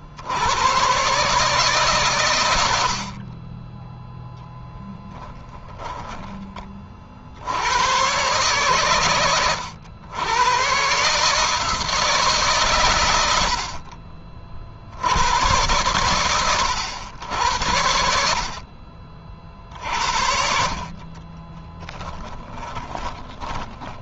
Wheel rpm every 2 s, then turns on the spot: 110, 80, 10, 30, 130, 130, 130, 60, 110, 40, 40, 10.
4-6 20-24